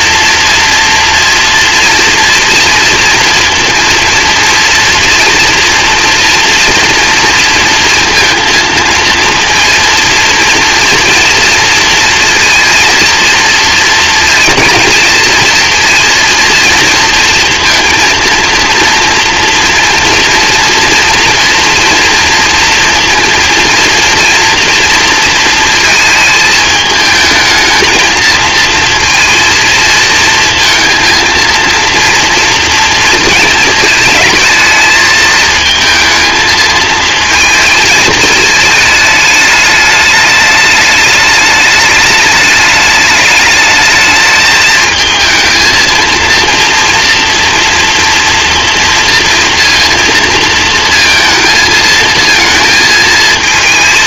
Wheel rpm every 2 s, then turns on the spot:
230, 230, 230, 240, 230, 230, 230, 220, 230, 230, 240, 230, 230, 220, 230, 230, 230, 220, 220, 220, 210, 220, 220, 230, 230, 230, 220.
none